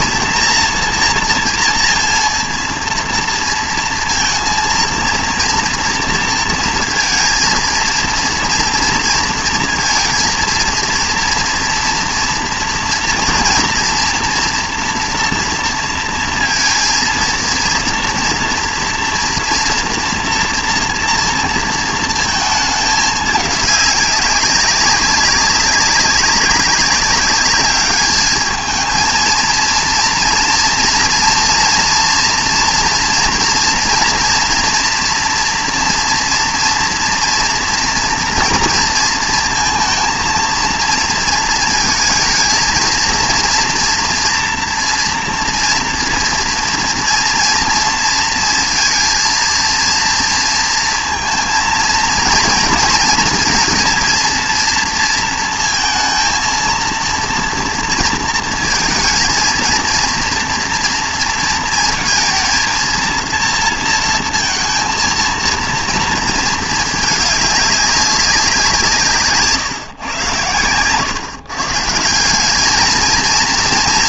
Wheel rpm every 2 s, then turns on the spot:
230, 230, 230, 230, 230, 230, 230, 230, 230, 230, 230, 220, 200, 200, 220, 230, 230, 240, 230, 230, 230, 220, 230, 230, 230, 230, 230, 230, 230, 220, 230, 230, 220, 220, 180, 110, 200.
none